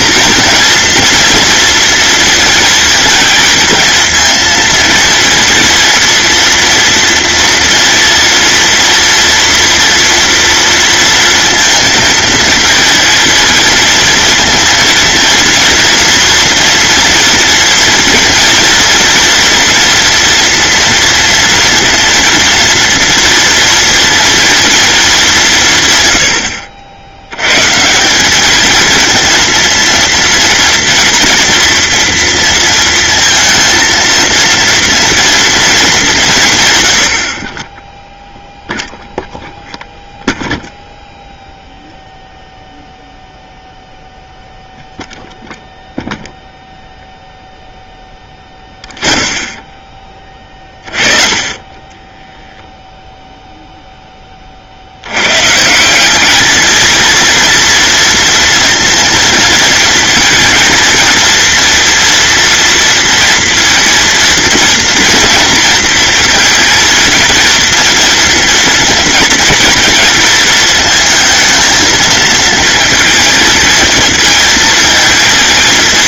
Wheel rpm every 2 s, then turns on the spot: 240, 230, 230, 230, 230, 230, 230, 230, 240, 230, 230, 230, 200, 80, 230, 230, 230, 230, 70, 0, 0, 0, 0, 0, 0, 20, 0, 90, 220, 230, 230, 230, 230, 230, 230, 230, 230, 230.
none